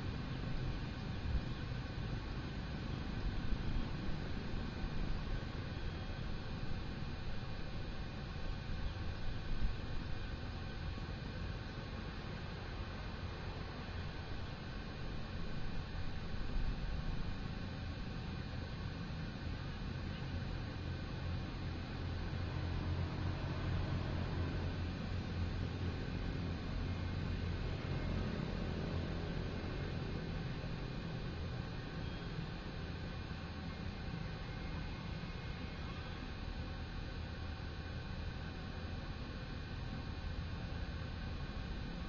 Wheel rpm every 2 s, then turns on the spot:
0, 0, 0, 0, 0, 0, 0, 0, 0, 0, 0, 0, 0, 0, 0, 0, 0, 0, 0, 0, 0.
none